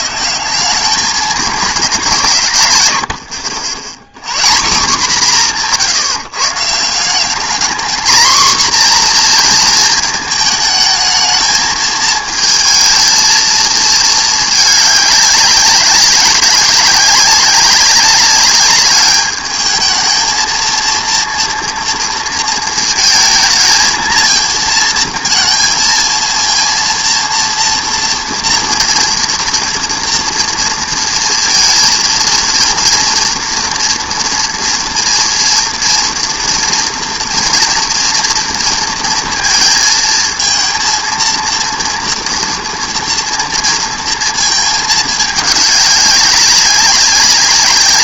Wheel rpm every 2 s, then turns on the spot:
190, 140, 170, 150, 240, 220, 220, 210, 190, 200, 220, 230, 220, 230, 230, 230, 230, 230, 230, 230, 230, 230, 220, 200.
none